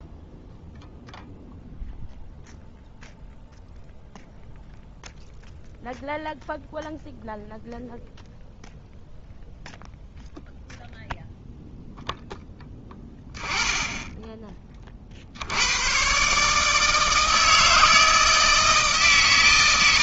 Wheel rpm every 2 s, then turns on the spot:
0, 0, 0, 0, 0, 0, 10, 20, 150, 160.
none